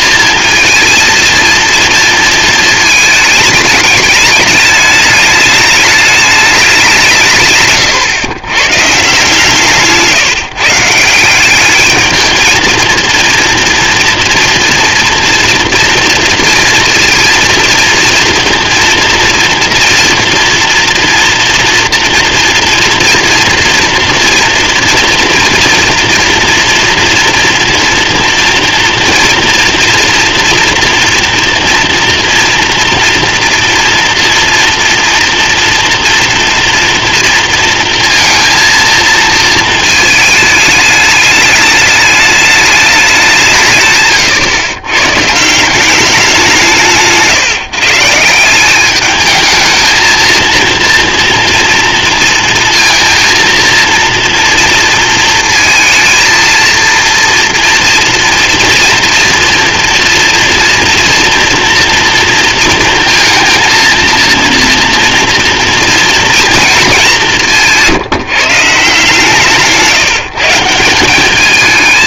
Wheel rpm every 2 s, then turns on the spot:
230, 220, 210, 160, 150, 180, 230, 240, 230, 230, 230, 230, 230, 230, 230, 230, 230, 240, 230, 230, 210, 180, 130, 150, 210, 230, 230, 230, 230, 230, 230, 230, 230, 190, 160, 190.
none